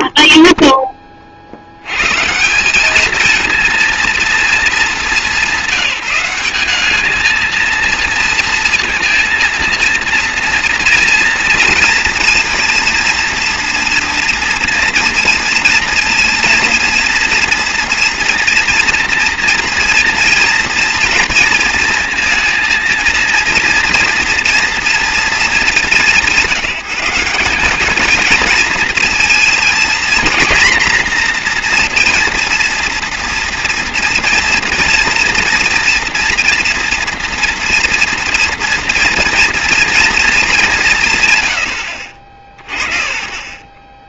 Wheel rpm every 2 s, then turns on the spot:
10, 190, 220, 210, 230, 230, 230, 230, 230, 230, 240, 230, 240, 190, 230, 240, 230, 230, 230, 230, 190, 50.
42-44